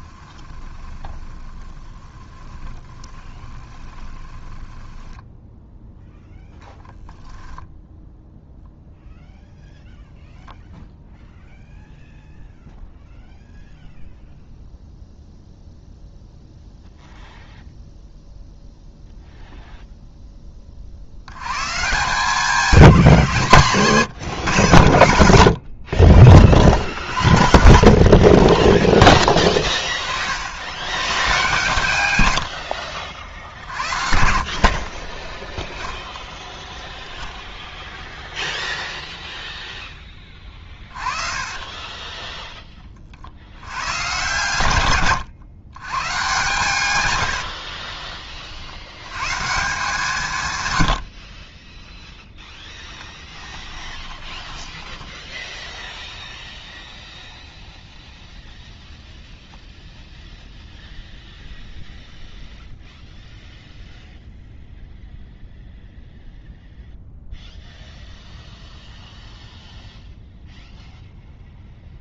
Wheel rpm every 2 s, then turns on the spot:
20, 30, 10, 0, 0, 0, 0, 0, 0, 0, 30, 190, 110, 40, 40, 80, 80, 50, 0, 0, 30, 10, 130, 130, 70, 120, 0, 10, 0, 0, 0, 0, 0, 0, 0, 0.
0-6 28-30 32-36 40-42 54-56